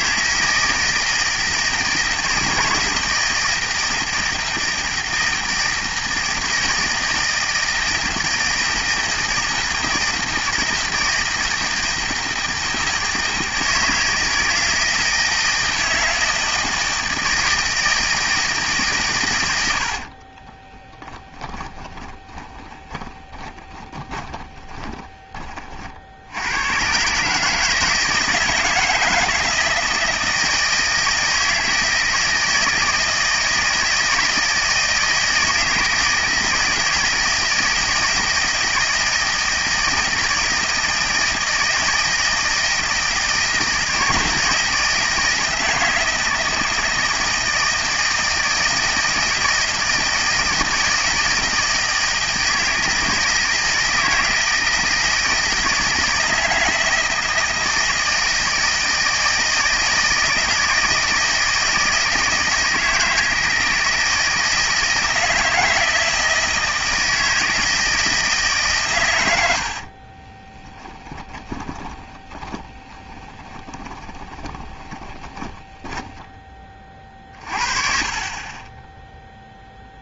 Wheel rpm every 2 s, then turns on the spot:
160, 160, 160, 160, 160, 160, 160, 160, 160, 160, 30, 20, 20, 100, 160, 160, 160, 160, 160, 160, 160, 160, 160, 160, 160, 160, 160, 160, 160, 160, 160, 160, 160, 160, 140, 20, 20, 20, 30, 10.
20-26 70-76